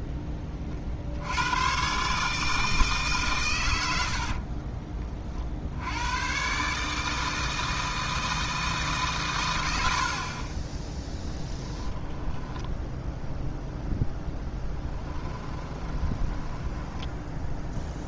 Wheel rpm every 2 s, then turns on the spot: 30, 150, 30, 150, 150, 10, 0, 10, 10.
14-18